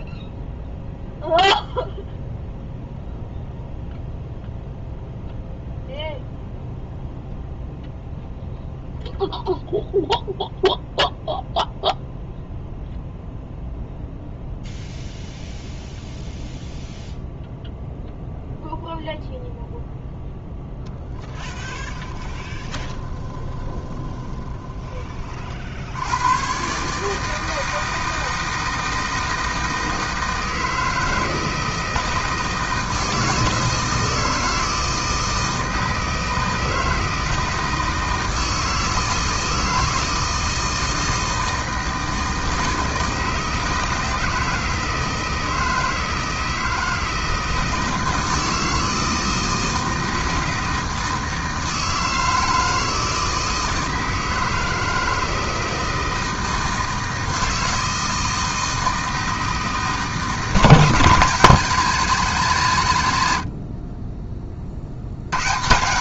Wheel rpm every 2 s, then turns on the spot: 0, 0, 0, 0, 0, 0, 0, 0, 0, 0, 0, 30, 30, 150, 160, 160, 160, 160, 160, 160, 160, 160, 160, 160, 160, 160, 160, 160, 160, 160, 160, 130, 60.
22-24